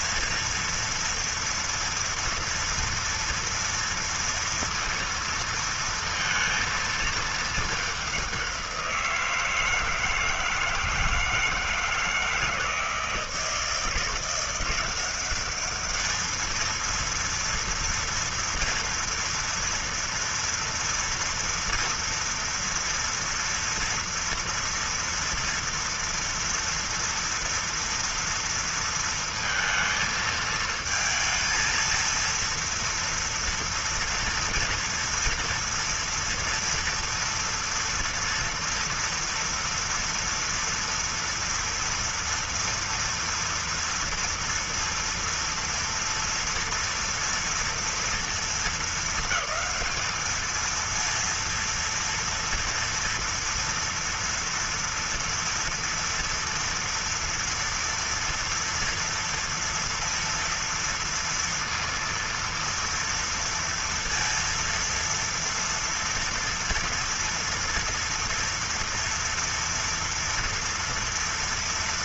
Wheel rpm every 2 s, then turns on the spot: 230, 230, 230, 230, 190, 160, 160, 170, 230, 230, 230, 230, 240, 240, 230, 220, 230, 230, 230, 240, 230, 230, 230, 230, 230, 220, 230, 230, 230, 230, 230, 230, 230, 230, 230, 230.
none